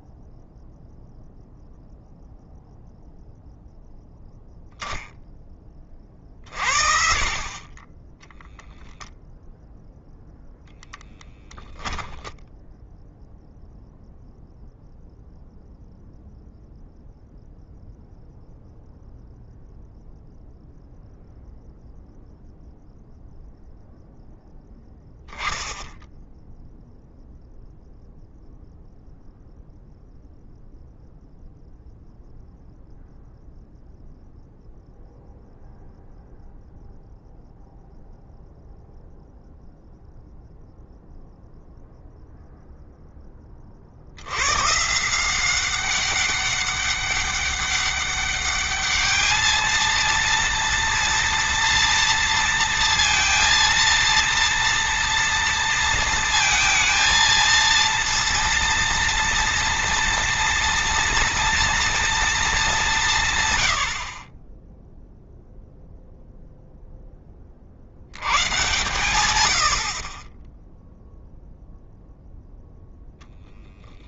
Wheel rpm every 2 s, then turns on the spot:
0, 0, 20, 50, 0, 0, 0, 0, 0, 0, 0, 0, 0, 0, 0, 0, 0, 0, 0, 0, 0, 0, 130, 200, 210, 230, 230, 230, 230, 230, 230, 210, 20, 0, 100, 10, 0.
none